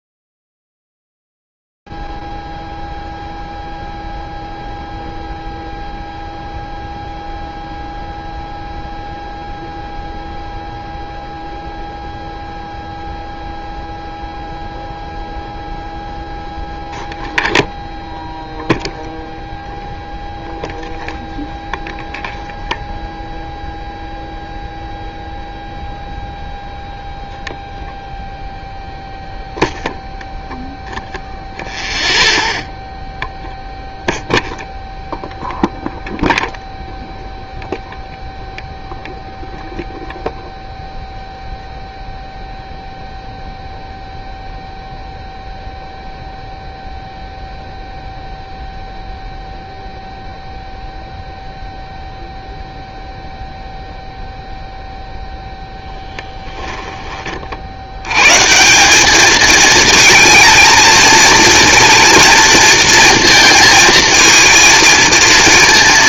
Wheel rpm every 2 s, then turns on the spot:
0, 0, 0, 0, 0, 0, 0, 0, 0, 0, 0, 0, 0, 0, 0, 0, 0, 0, 0, 0, 0, 0, 0, 0, 0, 0, 0, 0, 10, 180, 230, 230, 230.
none